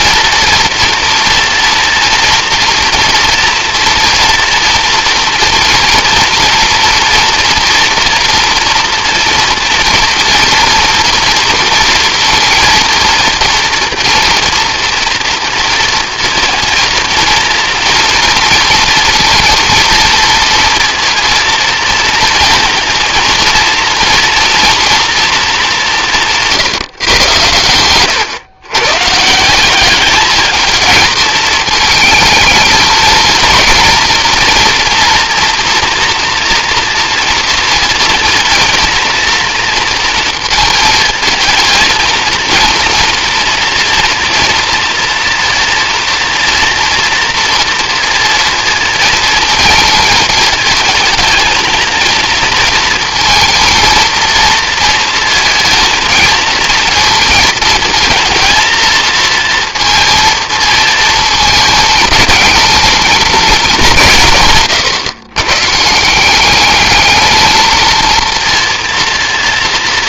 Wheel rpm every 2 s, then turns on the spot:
230, 230, 230, 230, 230, 230, 230, 230, 230, 230, 230, 230, 230, 180, 120, 210, 220, 230, 230, 230, 230, 230, 240, 230, 230, 220, 230, 230, 220, 230, 230, 220, 150, 190, 230.
none